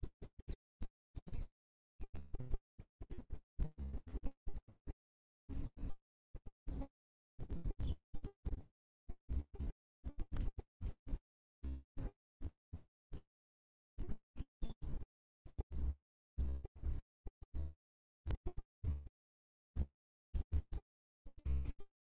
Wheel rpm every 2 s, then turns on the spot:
0, 0, 0, 0, 0, 0, 0, 0, 0, 0, 0.
none